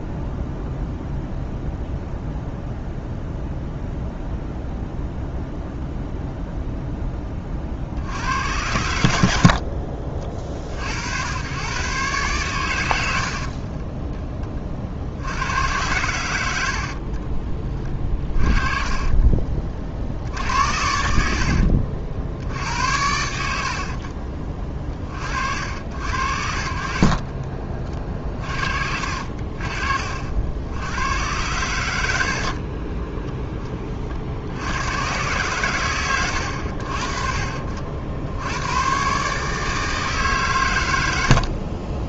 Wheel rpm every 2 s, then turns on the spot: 0, 0, 0, 10, 80, 70, 80, 60, 70, 40, 70, 80, 30, 60, 50, 90, 40, 100, 50, 120, 90.
16-20 26-28 32-34